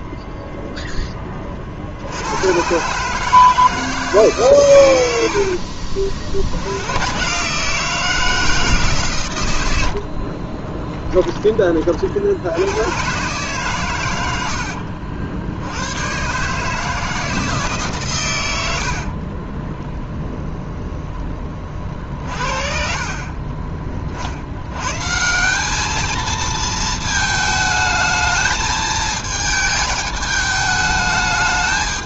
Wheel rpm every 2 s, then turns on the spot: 10, 140, 100, 100, 140, 20, 120, 70, 150, 70, 0, 30, 130, 220, 220, 210.
10-12 14-16 18-20